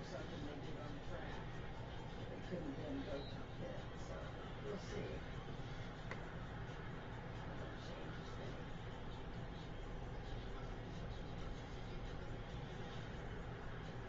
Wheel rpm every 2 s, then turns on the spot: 0, 0, 0, 0, 0, 0, 0.
none